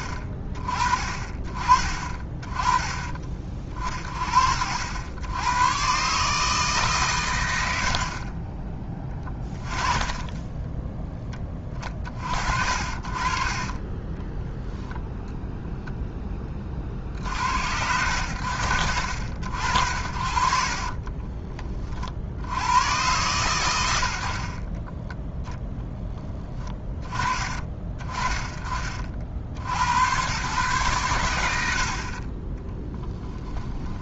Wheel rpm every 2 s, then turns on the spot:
30, 20, 80, 140, 10, 10, 60, 0, 40, 70, 40, 80, 20, 20, 30, 120, 10.
20-22 32-34